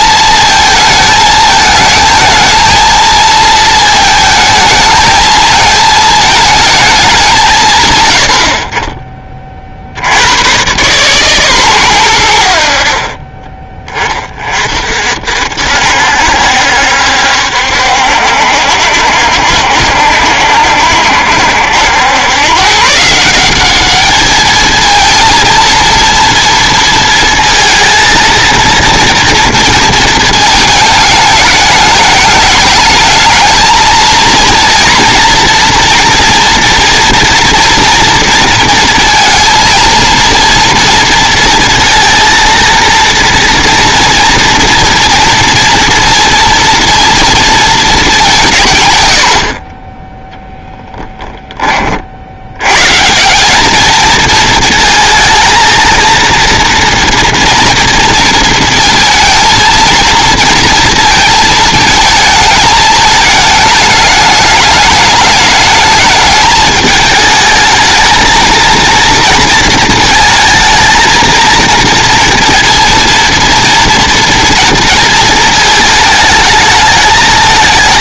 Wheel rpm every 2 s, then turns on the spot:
220, 230, 220, 220, 40, 110, 70, 40, 70, 60, 60, 130, 220, 230, 230, 220, 210, 230, 230, 230, 230, 230, 240, 230, 150, 10, 100, 230, 230, 230, 230, 220, 210, 210, 230, 220, 230, 230, 220.
none